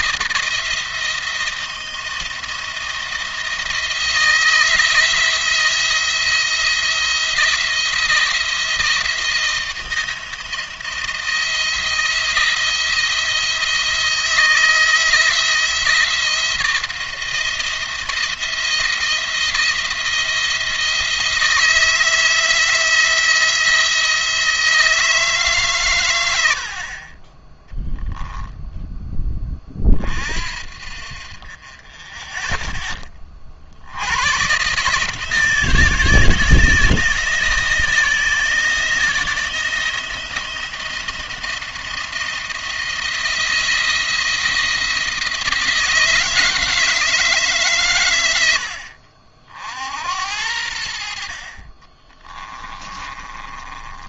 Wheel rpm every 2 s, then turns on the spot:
170, 170, 170, 170, 170, 170, 170, 170, 170, 170, 170, 160, 160, 50, 0, 50, 10, 140, 160, 160, 160, 170, 160, 160, 70, 70, 20.
52-54